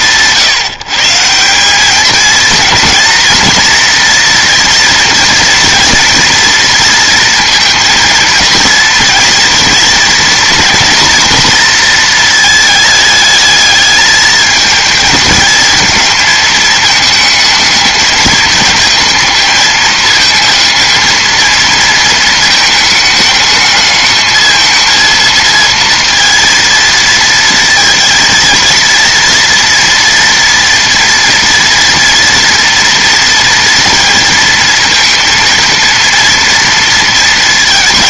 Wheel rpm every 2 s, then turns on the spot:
150, 230, 240, 230, 220, 230, 220, 220, 220, 220, 220, 220, 220, 230, 230, 230, 230, 230, 230.
none